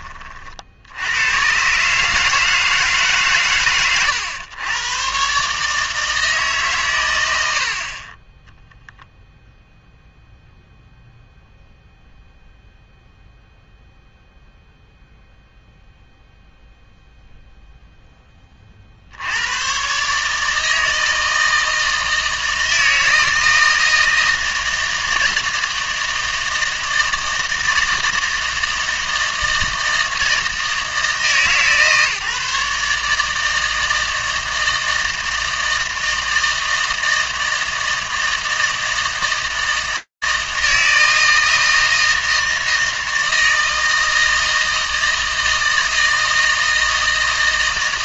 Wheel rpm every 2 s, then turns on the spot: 80, 160, 110, 120, 0, 0, 0, 0, 0, 50, 160, 160, 160, 160, 160, 160, 150, 160, 160, 160, 160, 160, 160, 160.
none